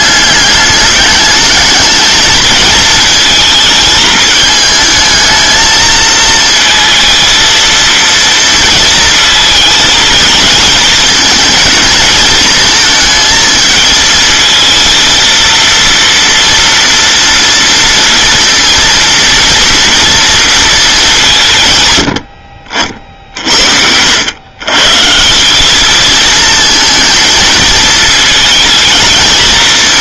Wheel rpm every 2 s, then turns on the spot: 210, 230, 220, 220, 230, 220, 220, 230, 230, 230, 220, 60, 130, 230, 220.
none